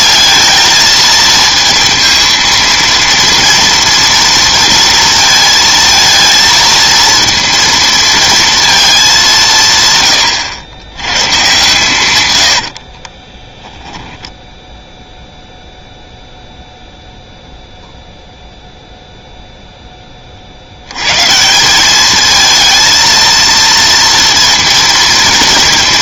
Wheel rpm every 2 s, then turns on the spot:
220, 230, 230, 230, 230, 100, 80, 10, 0, 0, 80, 220, 230.
12-14